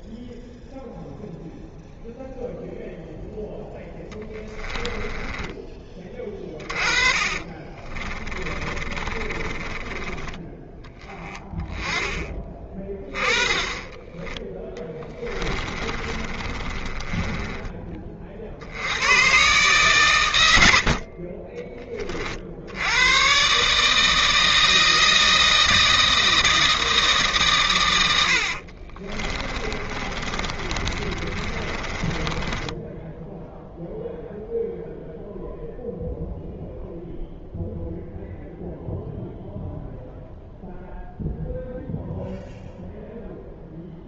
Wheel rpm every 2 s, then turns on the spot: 0, 0, 10, 40, 30, 10, 20, 10, 20, 90, 60, 90, 160, 160, 50, 30, 10, 0, 0, 0, 0, 0.
4-10 12-18 20-22 28-34